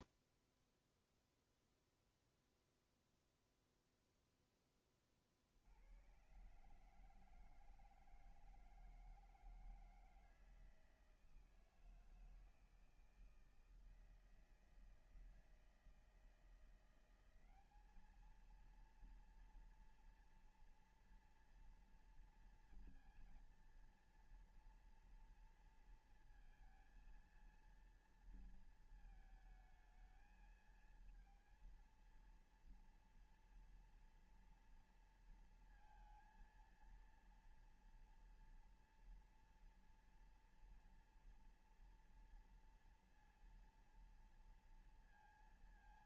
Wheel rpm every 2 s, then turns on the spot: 0, 0, 0, 130, 160, 160, 160, 160, 170, 220, 230, 230, 230, 230, 230, 220, 230, 230, 230, 240, 230, 230, 230.
none